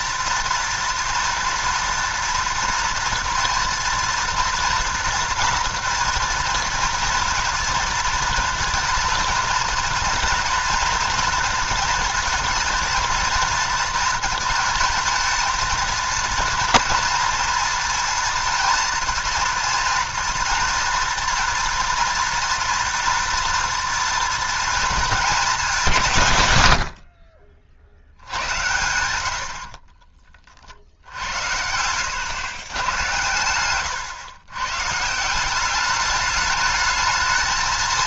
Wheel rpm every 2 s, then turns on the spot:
240, 240, 230, 230, 230, 240, 230, 230, 230, 230, 240, 230, 230, 90, 100, 50, 110, 120, 210.
none